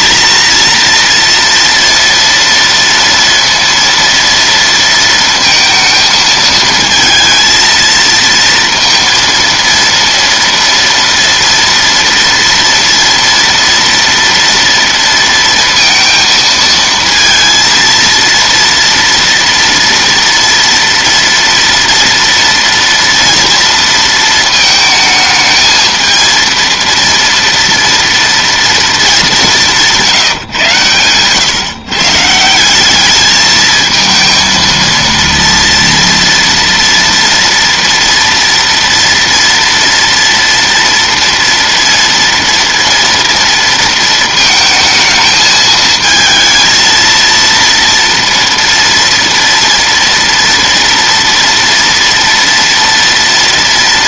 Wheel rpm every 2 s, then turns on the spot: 230, 230, 230, 220, 230, 230, 230, 230, 230, 230, 230, 230, 220, 230, 230, 130, 180, 230, 230, 230, 230, 230, 220, 220, 230, 230, 230.
none